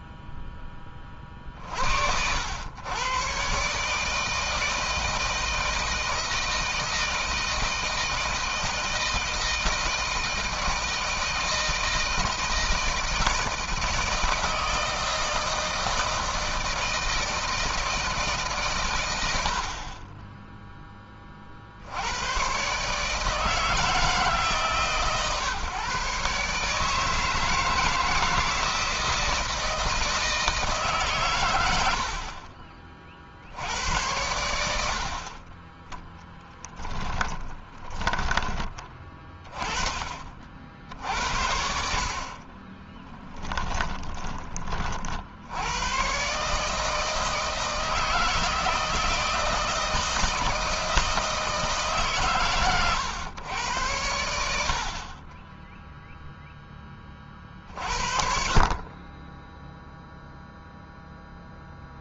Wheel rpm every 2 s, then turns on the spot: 10, 90, 160, 160, 160, 160, 160, 160, 160, 140, 10, 120, 140, 140, 160, 160, 50, 80, 10, 20, 60, 30, 30, 140, 160, 160, 130, 70, 10, 40, 0.
42-44